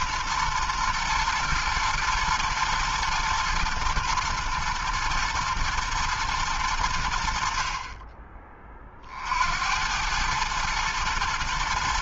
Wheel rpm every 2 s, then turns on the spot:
120, 110, 110, 110, 20, 110.
none